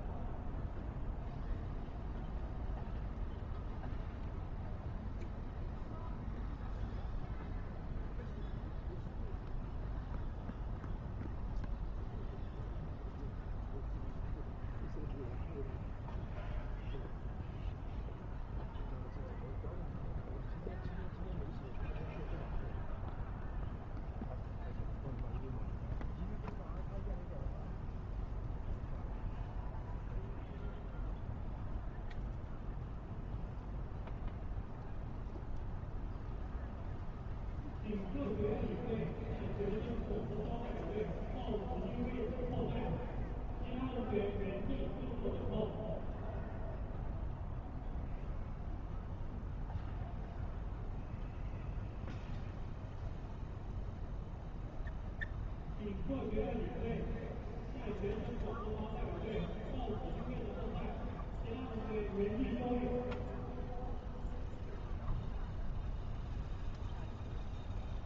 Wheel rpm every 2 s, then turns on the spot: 0, 0, 0, 0, 0, 0, 0, 0, 0, 0, 0, 0, 0, 0, 0, 0, 0, 0, 0, 0, 0, 0, 0, 0, 0, 0, 0, 0, 0, 0, 0, 0, 0, 0.
none